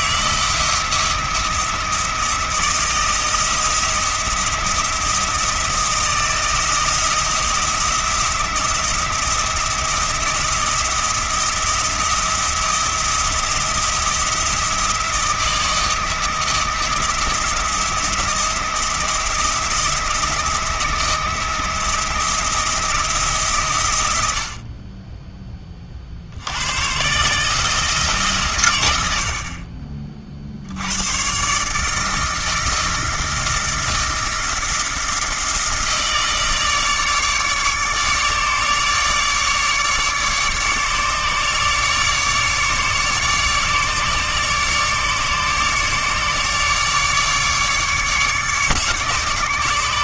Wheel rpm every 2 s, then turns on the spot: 170, 170, 170, 170, 170, 170, 170, 170, 170, 170, 170, 160, 30, 110, 100, 110, 160, 160, 150, 150, 150, 150, 150, 150, 150.
none